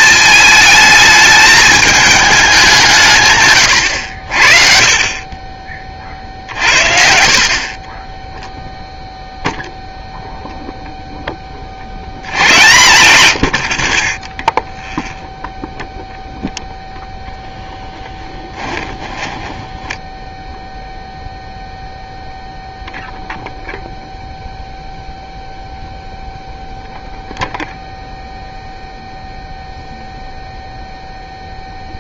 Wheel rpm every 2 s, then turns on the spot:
220, 180, 50, 50, 0, 0, 110, 0, 0, 10, 0, 0, 0, 0, 0, 0.
18-20